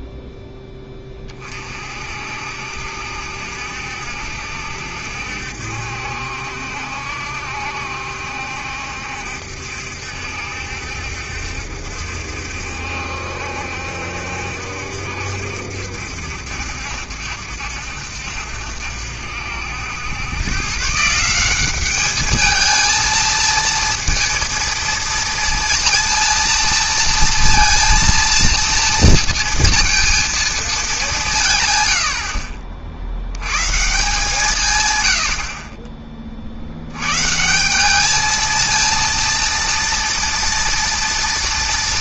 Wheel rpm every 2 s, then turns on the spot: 10, 60, 70, 70, 70, 70, 70, 70, 70, 60, 130, 220, 230, 230, 230, 220, 50, 140, 70, 220, 230.
32-34